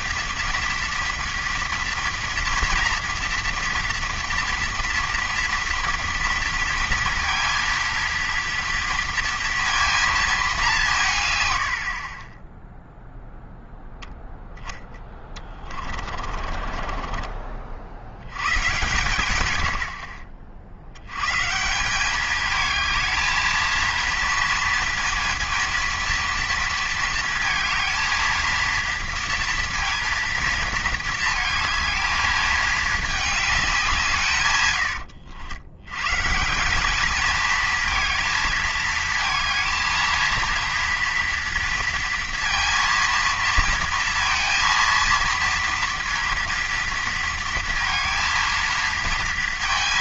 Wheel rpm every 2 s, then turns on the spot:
230, 230, 230, 230, 230, 190, 10, 10, 40, 120, 70, 220, 230, 230, 230, 230, 220, 120, 180, 220, 230, 230, 230, 230, 230.
14-18